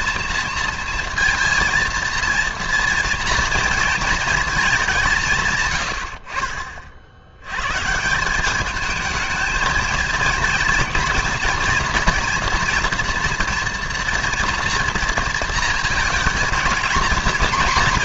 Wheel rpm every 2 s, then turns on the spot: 230, 230, 210, 40, 200, 230, 240, 230, 230.
none